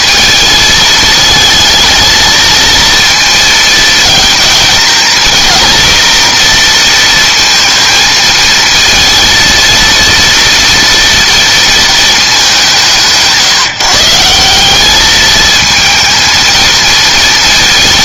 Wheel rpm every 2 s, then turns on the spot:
220, 230, 230, 230, 220, 230, 180, 190, 230.
none